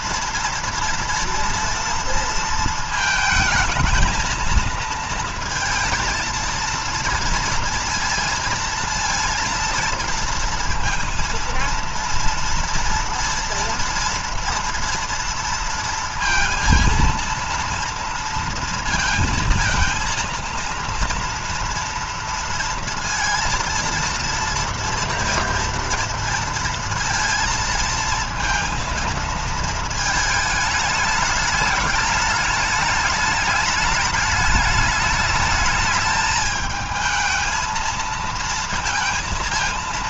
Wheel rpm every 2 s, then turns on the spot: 230, 230, 230, 230, 230, 230, 230, 230, 230, 230, 230, 230, 230, 230, 230, 210, 210, 220, 220, 230.
none